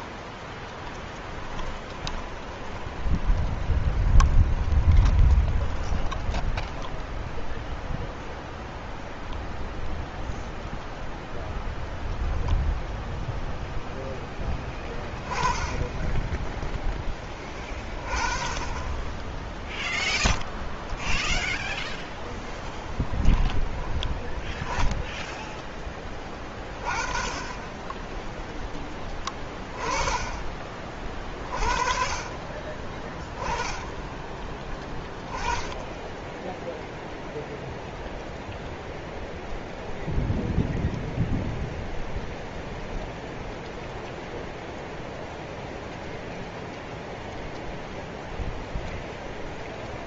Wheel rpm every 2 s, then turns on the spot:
10, 20, 20, 0, 0, 0, 0, 10, 10, 10, 0, 10, 10, 30, 20, 30, 20, 20, 0, 0, 0, 0, 0, 0, 0.
0-6 22-24